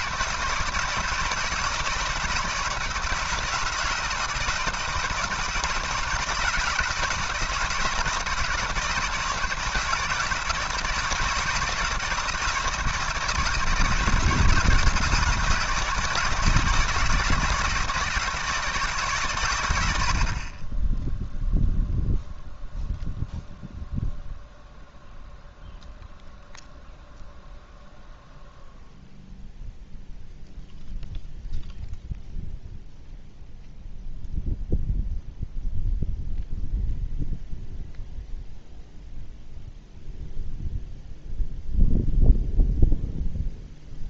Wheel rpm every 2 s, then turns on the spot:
160, 160, 160, 160, 170, 160, 160, 160, 160, 160, 20, 0, 0, 0, 0, 0, 0, 0, 0, 0, 0, 0.
none